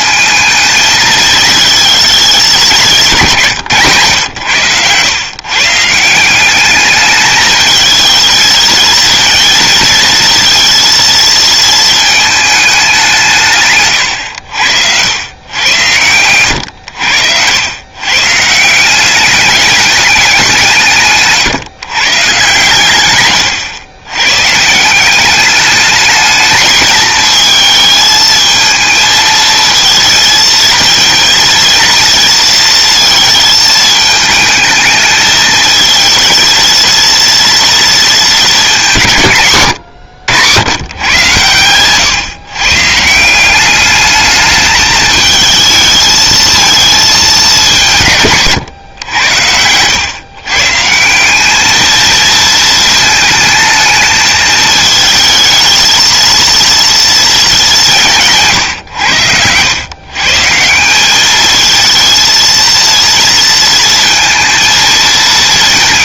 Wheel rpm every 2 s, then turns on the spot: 220, 170, 120, 210, 230, 230, 180, 100, 90, 190, 150, 120, 190, 220, 220, 230, 220, 220, 230, 170, 120, 170, 220, 210, 90, 180, 220, 220, 230, 110, 200, 230, 220.
none